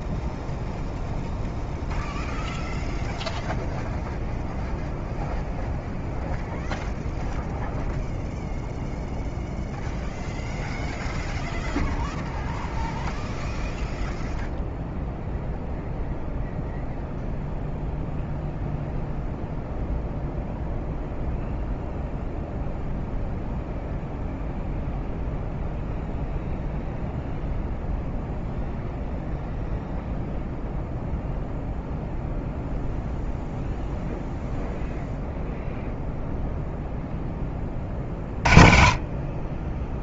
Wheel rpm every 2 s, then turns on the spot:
0, 0, 0, 0, 0, 0, 0, 0, 0, 0, 0, 0, 0, 0, 0, 0, 0, 0, 0, 30.
none